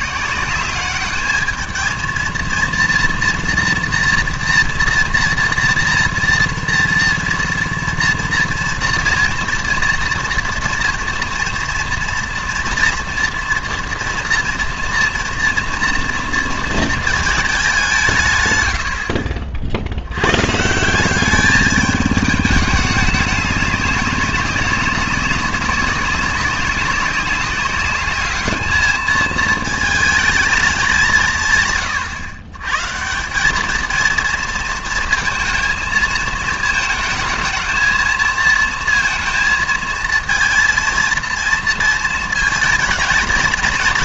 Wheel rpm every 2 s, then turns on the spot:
190, 230, 230, 230, 230, 230, 230, 230, 230, 90, 150, 210, 200, 200, 210, 210, 130, 230, 220, 230, 230, 230.
none